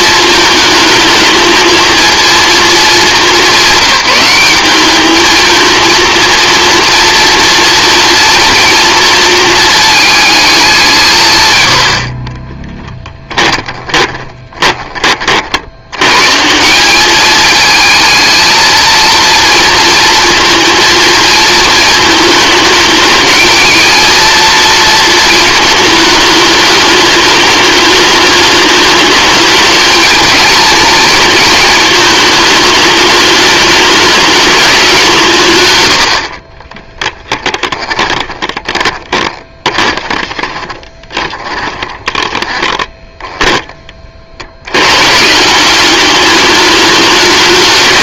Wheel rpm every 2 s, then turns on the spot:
220, 220, 200, 230, 230, 180, 10, 20, 190, 230, 230, 220, 230, 210, 210, 220, 210, 200, 30, 20, 30, 20, 100, 210.
12-14 36-44